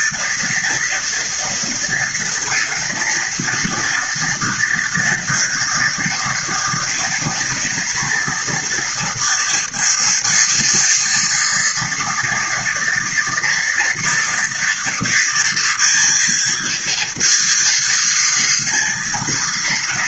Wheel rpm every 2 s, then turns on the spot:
230, 230, 230, 230, 240, 230, 240, 230, 230, 230.
none